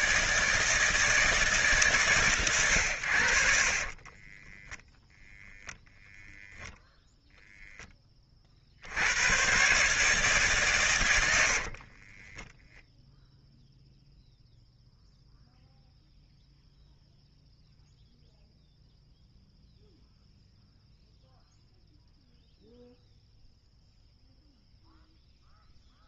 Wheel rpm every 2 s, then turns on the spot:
160, 100, 10, 0, 50, 130, 0, 0, 0, 0, 0, 0, 0.
4-6